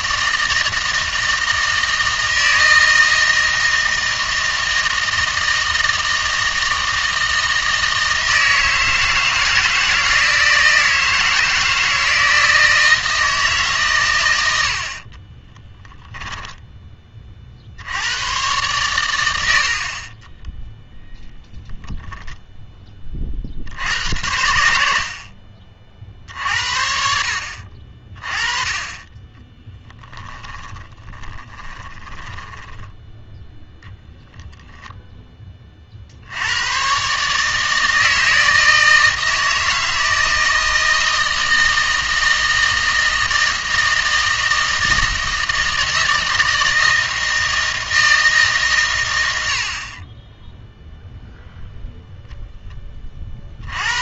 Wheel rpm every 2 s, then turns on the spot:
160, 160, 160, 160, 160, 160, 160, 90, 10, 110, 10, 10, 80, 60, 20, 10, 10, 0, 100, 160, 160, 160, 160, 160, 140, 0, 10.
20-22 30-34